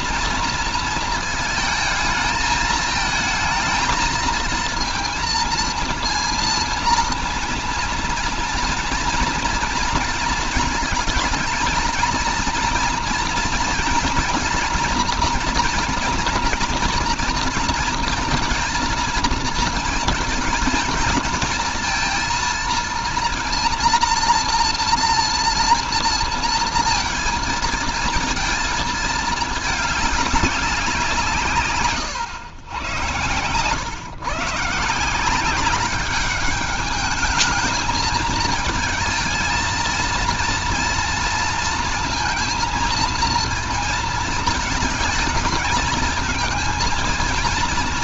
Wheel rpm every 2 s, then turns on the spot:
230, 220, 230, 230, 230, 220, 230, 230, 240, 220, 220, 230, 230, 230, 220, 180, 100, 150, 210, 220, 230, 230, 210, 220.
none